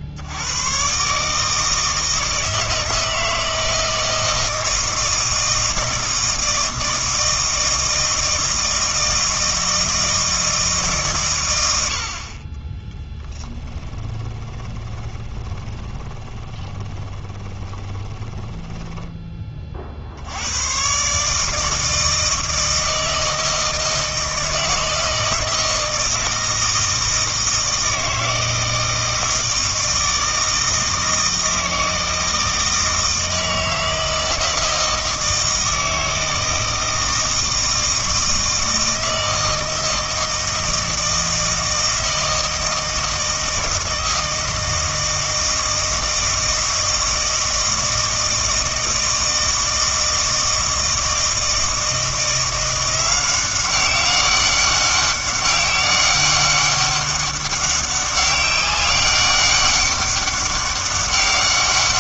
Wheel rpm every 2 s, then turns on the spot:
100, 160, 160, 160, 160, 150, 20, 20, 10, 10, 110, 160, 160, 160, 160, 160, 160, 160, 160, 160, 160, 160, 160, 160, 160, 160, 170, 190, 200, 200, 200.
14-18